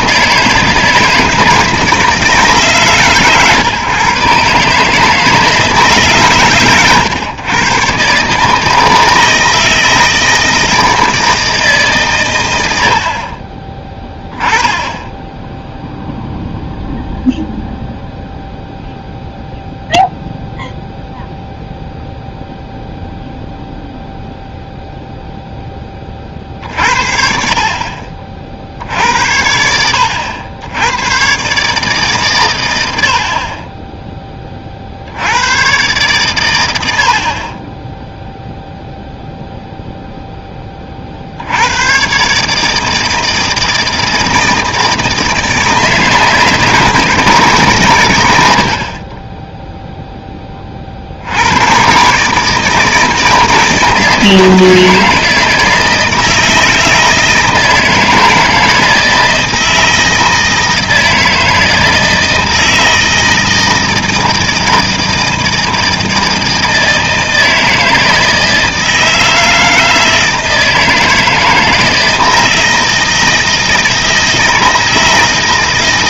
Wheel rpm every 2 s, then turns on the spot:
160, 150, 140, 130, 160, 160, 90, 10, 0, 0, 0, 0, 0, 50, 60, 80, 100, 40, 100, 0, 10, 150, 160, 160, 70, 20, 150, 160, 160, 160, 160, 160, 160, 160, 160, 160, 160, 160.
none